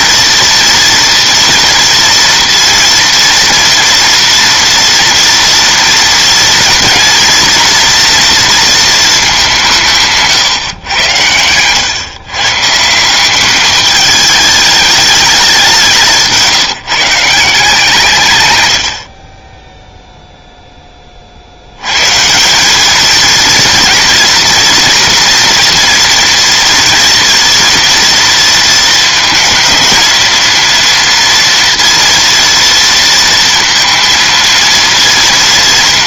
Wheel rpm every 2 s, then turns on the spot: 230, 230, 230, 230, 230, 110, 150, 210, 160, 110, 0, 200, 240, 240, 230, 230, 230, 230.
none